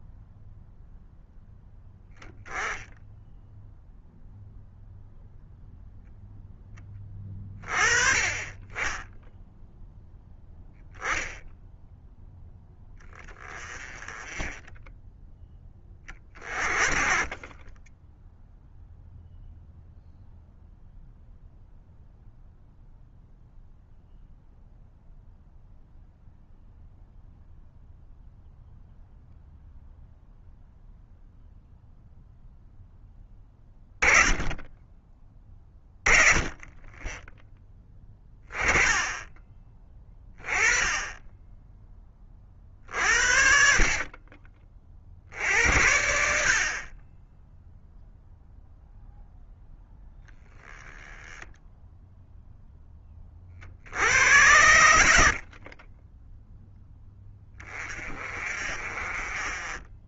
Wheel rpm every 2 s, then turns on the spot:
0, 10, 0, 10, 20, 0, 10, 10, 40, 0, 0, 0, 0, 0, 0, 0, 0, 10, 20, 10, 20, 40, 40, 50, 0, 10, 0, 90, 10, 40.
none